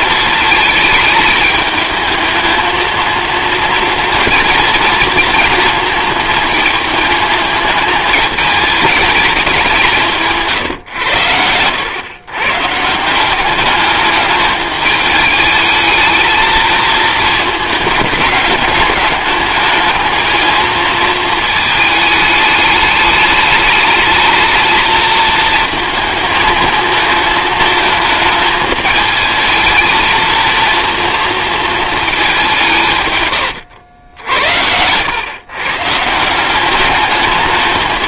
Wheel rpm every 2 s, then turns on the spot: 210, 220, 230, 220, 210, 140, 150, 210, 220, 210, 230, 210, 220, 220, 210, 230, 170, 100, 200.
none